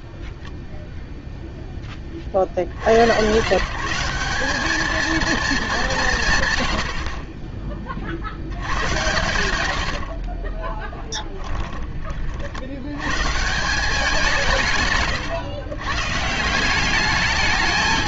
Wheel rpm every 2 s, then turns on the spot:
0, 70, 210, 130, 80, 30, 70, 150, 180.
10-12